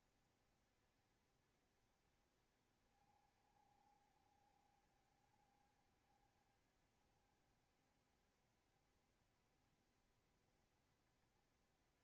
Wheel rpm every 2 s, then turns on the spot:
70, 60, 60, 70, 70, 70.
none